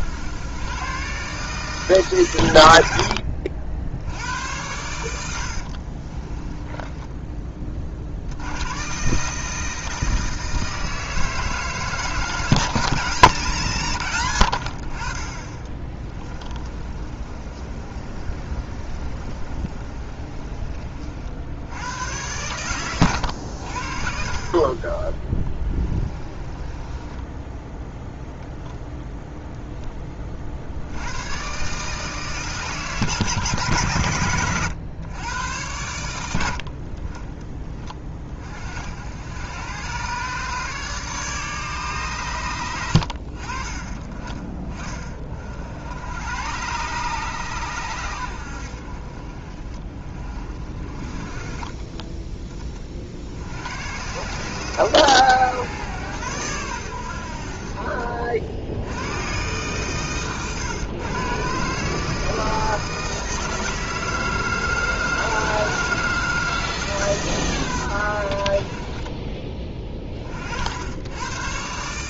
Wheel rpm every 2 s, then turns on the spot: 120, 80, 90, 10, 110, 160, 170, 50, 30, 30, 30, 110, 30, 20, 0, 70, 150, 110, 50, 60, 150, 90, 20, 130, 70, 30, 30, 120, 90, 90, 120, 160, 160, 150, 50, 80.
6-8 16-20 26-28